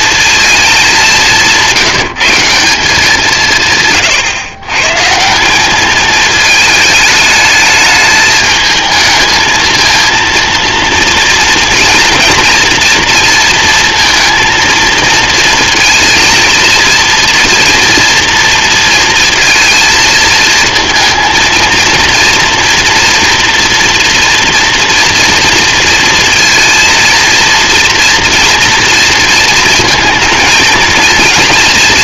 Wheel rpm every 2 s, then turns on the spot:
200, 180, 140, 220, 220, 230, 240, 230, 230, 230, 230, 230, 230, 230, 230, 230.
none